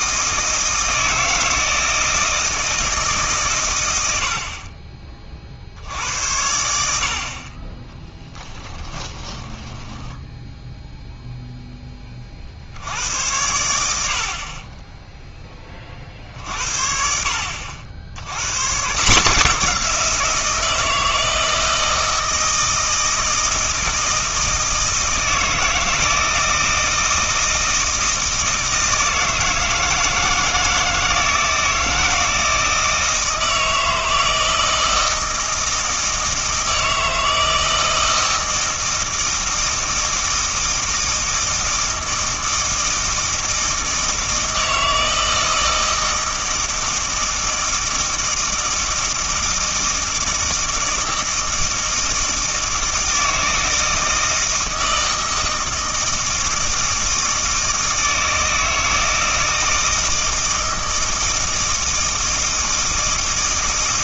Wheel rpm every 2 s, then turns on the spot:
160, 160, 30, 80, 20, 0, 80, 20, 60, 140, 160, 160, 160, 160, 160, 160, 160, 160, 160, 160, 160, 160, 160, 160, 160, 160, 160, 160, 160, 160, 160, 160.
8-10